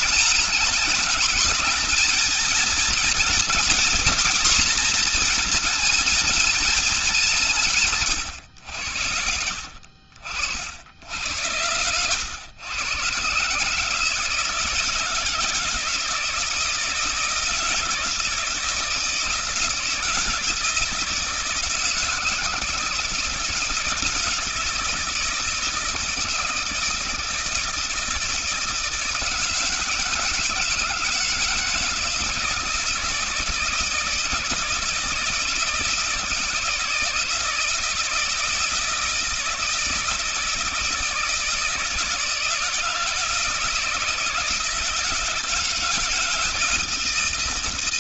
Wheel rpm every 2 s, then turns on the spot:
220, 220, 240, 210, 90, 60, 110, 150, 160, 160, 160, 160, 160, 160, 160, 160, 160, 170, 160, 160, 160, 160, 160, 170.
none